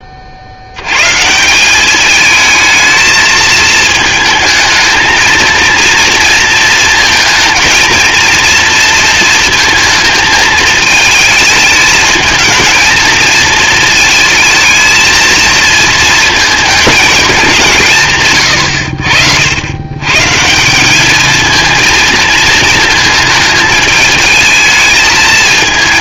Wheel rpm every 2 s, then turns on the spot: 150, 220, 220, 220, 230, 220, 220, 230, 210, 80, 210, 220, 220.
none